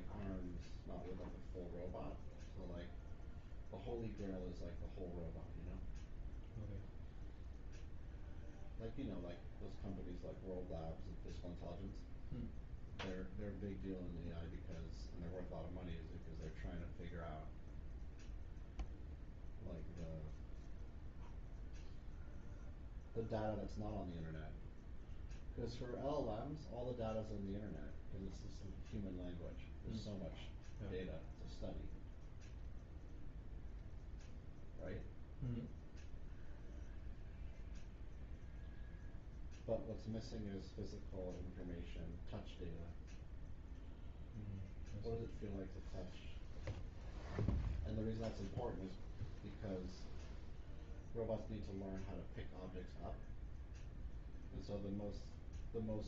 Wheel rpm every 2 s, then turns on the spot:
0, 0, 0, 0, 0, 0, 0, 0, 0, 0, 0, 0, 0, 0, 0, 0, 0, 0, 0, 0, 0, 0, 0, 0, 0, 0, 0, 0.
none